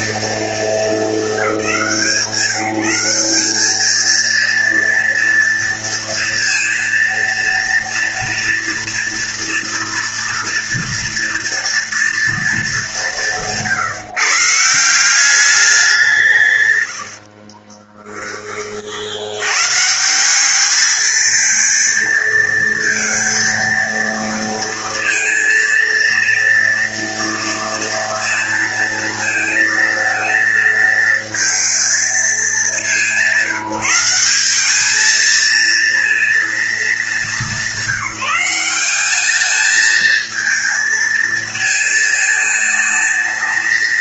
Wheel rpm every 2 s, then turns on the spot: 220, 180, 230, 230, 230, 230, 210, 160, 120, 40, 210, 230, 230, 230, 230, 230, 200, 200, 220, 190, 220, 220.
16-18